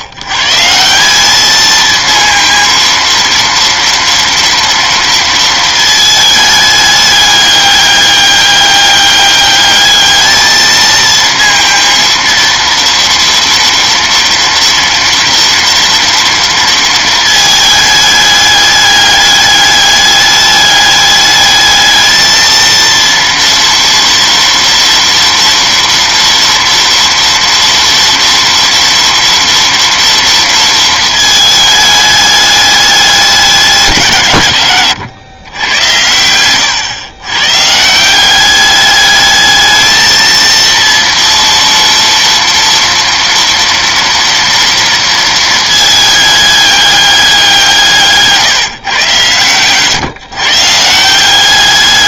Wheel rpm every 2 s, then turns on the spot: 110, 230, 230, 220, 200, 220, 230, 240, 230, 210, 210, 220, 230, 230, 230, 230, 210, 140, 110, 190, 230, 230, 230, 210, 140, 140.
none